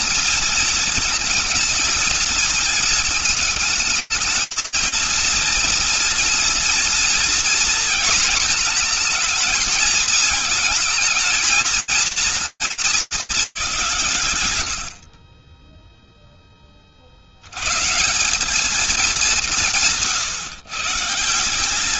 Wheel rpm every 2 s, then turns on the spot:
230, 230, 220, 230, 220, 220, 230, 130, 20, 200, 140.
none